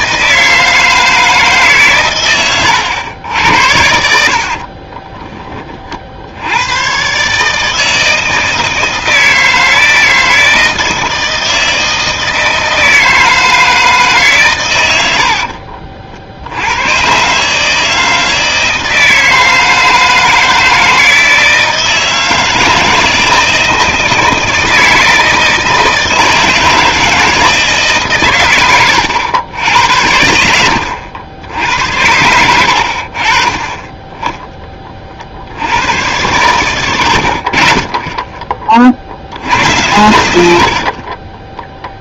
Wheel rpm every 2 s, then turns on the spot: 160, 100, 50, 100, 160, 160, 160, 100, 90, 160, 160, 160, 160, 160, 110, 90, 70, 20, 90, 30, 70.
4-6 36-38